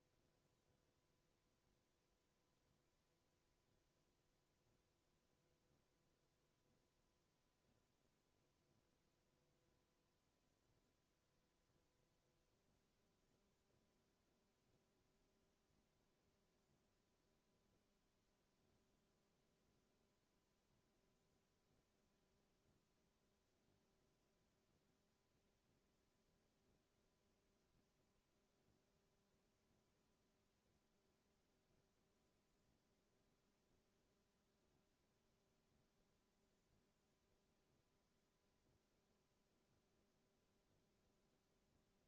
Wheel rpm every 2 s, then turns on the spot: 0, 0, 0, 0, 0, 0, 0, 0, 0, 0, 0, 0, 0, 0, 0, 0, 0, 0, 0, 0, 0.
none